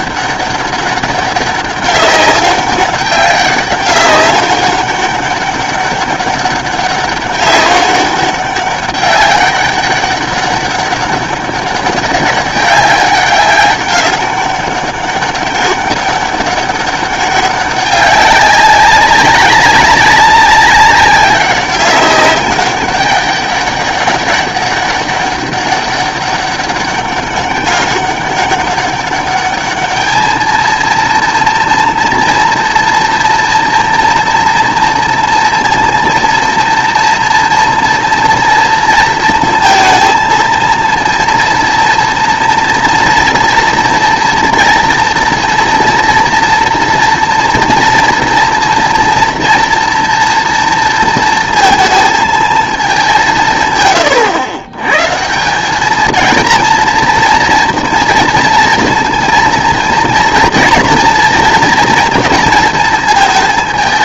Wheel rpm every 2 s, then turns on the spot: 200, 200, 200, 200, 200, 200, 200, 200, 200, 190, 200, 200, 200, 200, 200, 220, 230, 230, 230, 230, 220, 230, 230, 230, 230, 230, 220, 120, 230, 230, 230, 230.
none